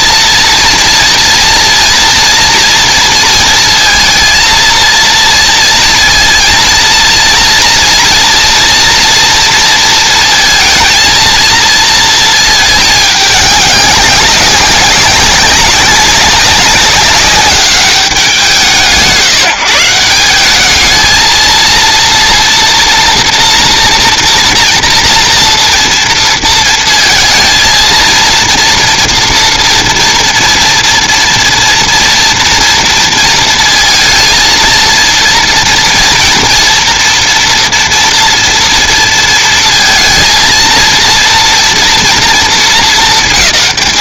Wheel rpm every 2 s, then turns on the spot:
230, 230, 230, 230, 240, 230, 210, 190, 200, 150, 220, 230, 230, 230, 230, 230, 230, 230, 230, 230, 230, 220.
none